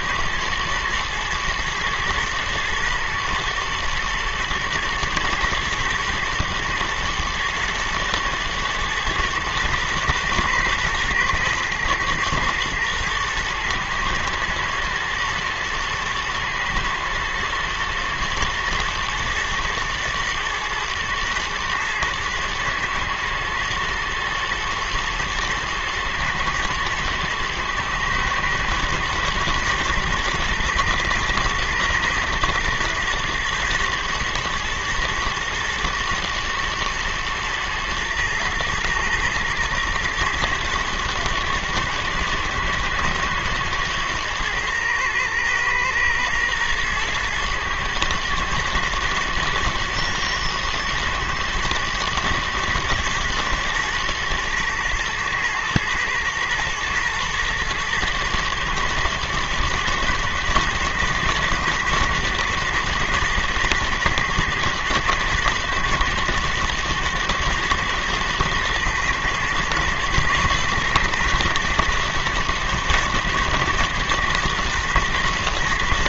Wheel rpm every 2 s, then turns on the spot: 120, 110, 120, 120, 120, 120, 110, 110, 120, 110, 110, 120, 110, 120, 120, 120, 110, 110, 110, 110, 110, 110, 110, 120, 110, 120, 110, 110, 110, 110, 110, 120, 120, 120, 110, 120, 110, 110.
none